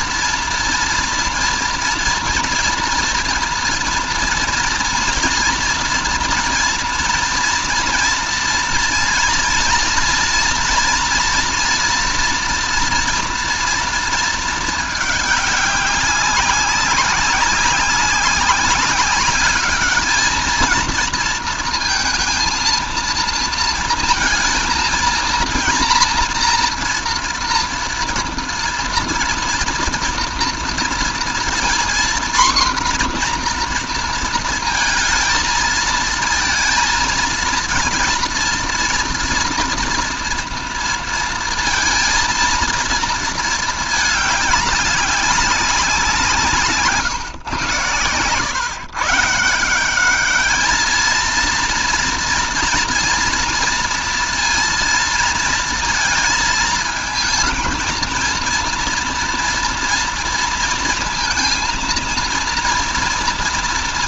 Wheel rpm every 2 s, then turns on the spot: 230, 230, 240, 230, 230, 240, 240, 210, 190, 200, 230, 230, 230, 240, 230, 230, 250, 220, 230, 230, 230, 230, 200, 150, 150, 230, 230, 230, 220, 230, 230, 240.
none